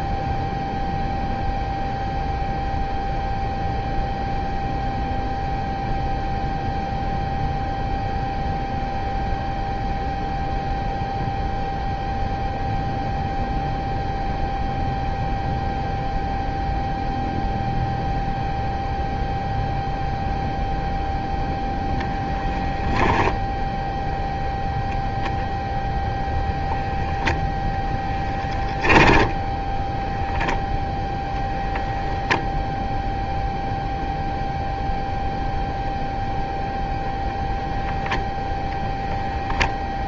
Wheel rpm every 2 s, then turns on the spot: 0, 0, 0, 0, 0, 0, 0, 0, 0, 0, 0, 0, 0, 0, 10, 0, 0, 0, 0, 0.
none